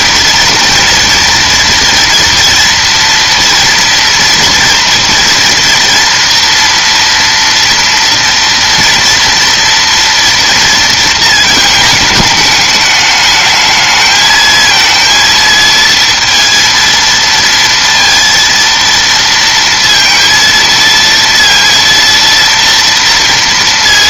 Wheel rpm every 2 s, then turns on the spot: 230, 230, 230, 230, 240, 230, 210, 230, 230, 230, 230, 230.
none